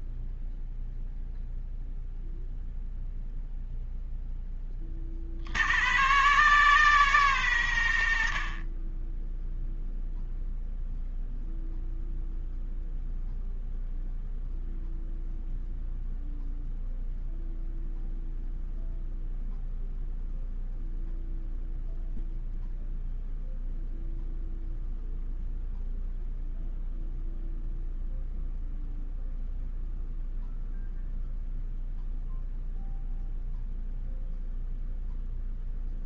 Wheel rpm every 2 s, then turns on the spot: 0, 0, 20, 70, 10, 0, 0, 0, 0, 0, 0, 0, 0, 0, 0, 0, 0, 0.
none